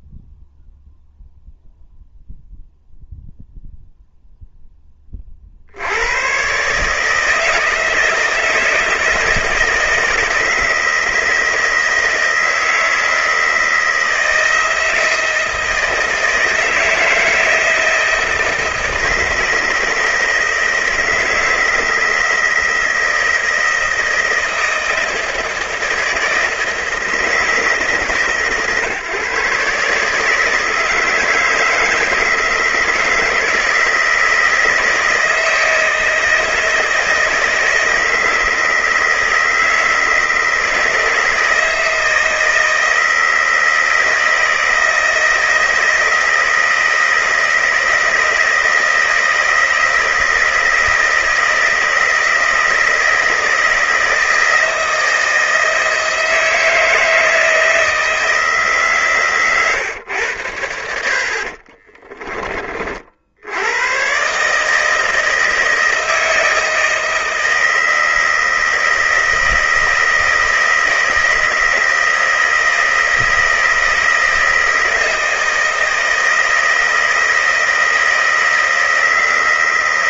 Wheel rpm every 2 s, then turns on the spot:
0, 0, 20, 140, 160, 170, 160, 170, 160, 160, 160, 160, 160, 160, 130, 160, 160, 160, 160, 160, 160, 160, 160, 160, 160, 160, 160, 160, 160, 150, 80, 40, 150, 160, 160, 160, 160, 160, 160, 160.
none